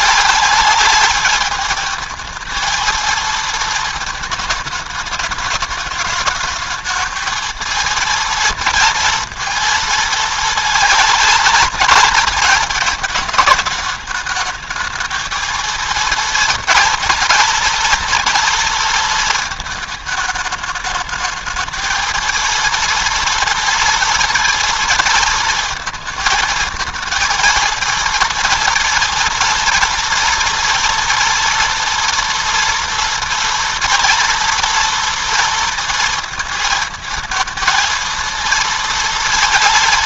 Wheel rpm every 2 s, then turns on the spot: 210, 230, 220, 220, 230, 230, 220, 220, 230, 230, 220, 230, 230, 220, 230, 230, 230, 230, 230, 230.
none